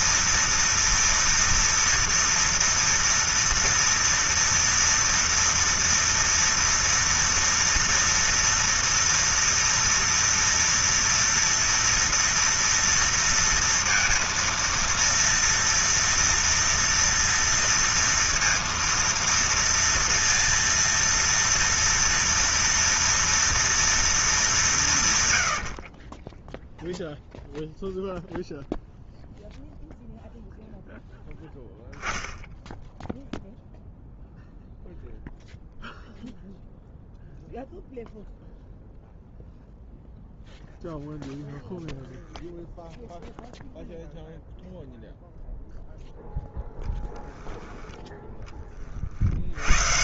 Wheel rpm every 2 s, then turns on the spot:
230, 240, 230, 230, 230, 230, 230, 230, 230, 230, 230, 230, 220, 40, 0, 0, 0, 0, 0, 0, 0, 0, 0, 0, 10.
none